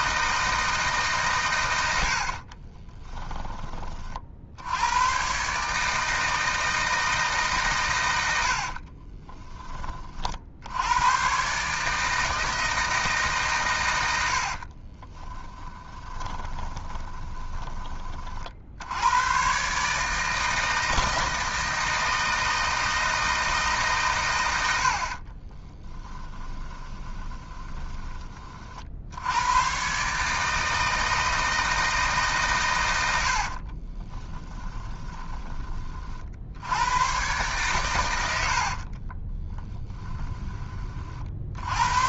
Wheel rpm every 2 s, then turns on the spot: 150, 20, 90, 160, 50, 100, 160, 30, 20, 80, 160, 160, 70, 20, 60, 160, 100, 20, 100, 50, 40.
2-4 8-10 14-18 26-28 38-40